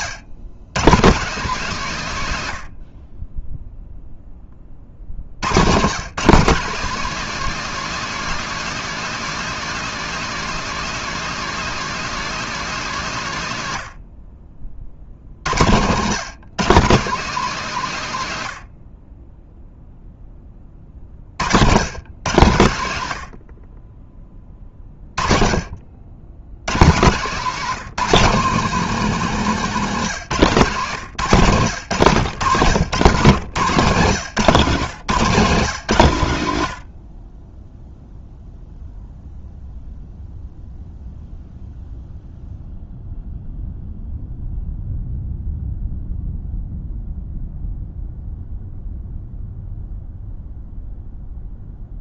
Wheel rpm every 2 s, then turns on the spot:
130, 70, 40, 210, 230, 230, 190, 50, 170, 50, 40, 100, 30, 130, 190, 150, 120, 160, 70, 0, 0, 0, 0, 0, 0, 0.
none